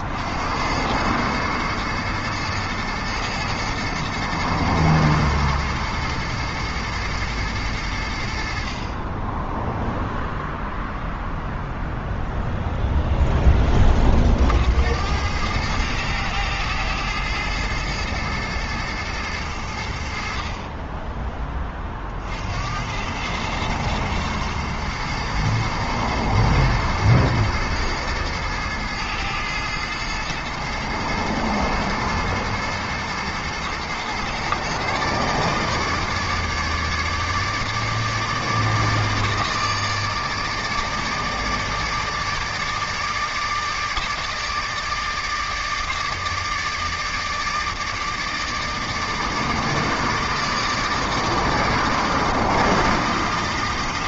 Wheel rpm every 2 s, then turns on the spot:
100, 110, 120, 120, 40, 0, 0, 80, 110, 110, 20, 90, 120, 110, 110, 110, 110, 140, 150, 150, 150, 160, 160, 160, 150, 160, 160.
none